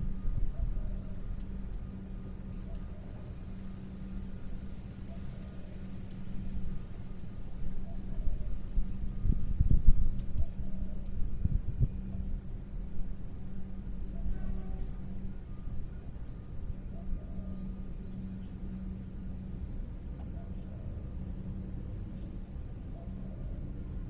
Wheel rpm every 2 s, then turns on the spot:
0, 0, 0, 0, 0, 0, 0, 0, 0, 0, 0, 0.
none